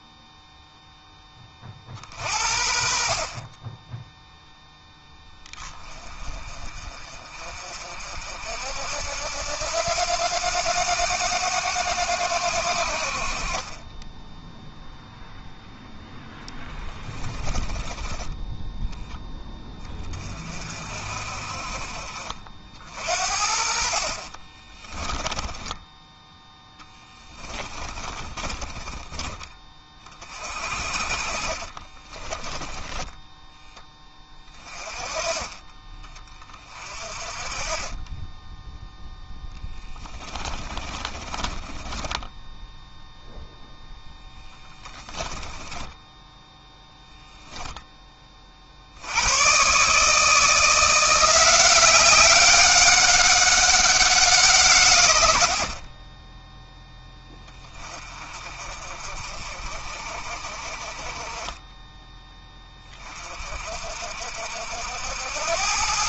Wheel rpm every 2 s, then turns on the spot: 10, 50, 0, 40, 70, 100, 60, 0, 20, 10, 40, 60, 20, 10, 20, 40, 10, 30, 30, 0, 30, 0, 10, 0, 80, 170, 190, 110, 10, 40, 30, 30, 80.
16-18 24-30 32-34 40-42 44-46